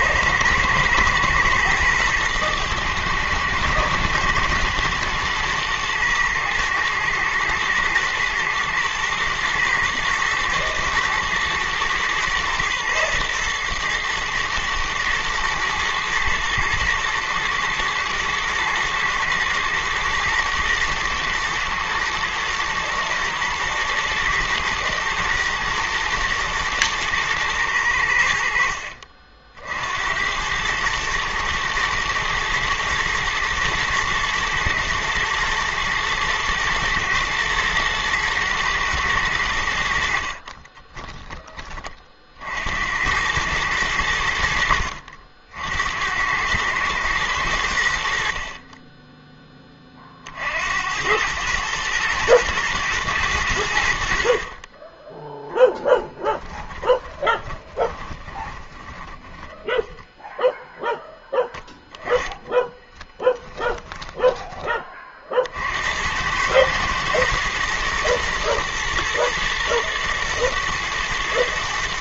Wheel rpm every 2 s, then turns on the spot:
110, 110, 120, 110, 120, 110, 120, 110, 110, 120, 110, 110, 110, 110, 70, 100, 110, 120, 120, 120, 30, 70, 70, 110, 30, 70, 110, 30, 20, 20, 0, 10, 20, 110, 110, 110.
40-42 56-60